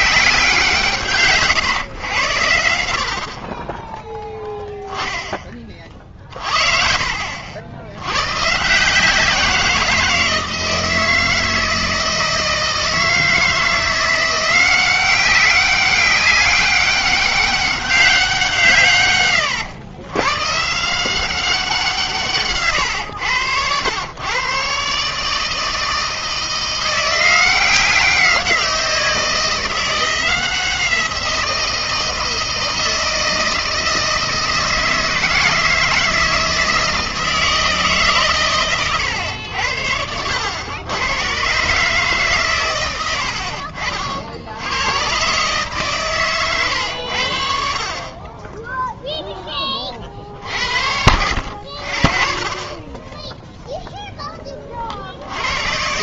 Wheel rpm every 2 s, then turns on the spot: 160, 80, 10, 40, 140, 160, 160, 180, 200, 160, 120, 140, 140, 170, 180, 170, 160, 160, 160, 130, 90, 130, 80, 110, 20, 50, 30, 30.
none